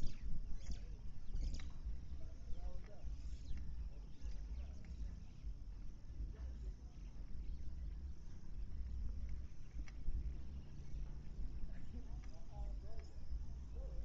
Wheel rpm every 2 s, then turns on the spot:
0, 0, 0, 0, 0, 0, 0.
none